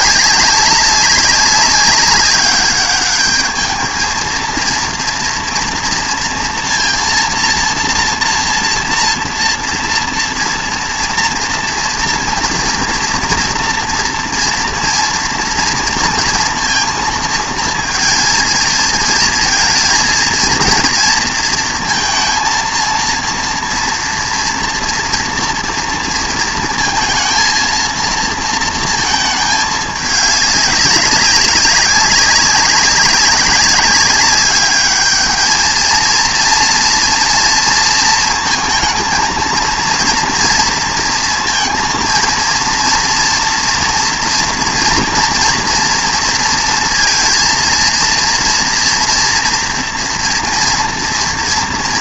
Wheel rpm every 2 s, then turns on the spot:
190, 200, 230, 230, 230, 230, 230, 230, 230, 220, 230, 230, 230, 230, 230, 190, 190, 210, 230, 220, 230, 230, 230, 230, 230, 240.
none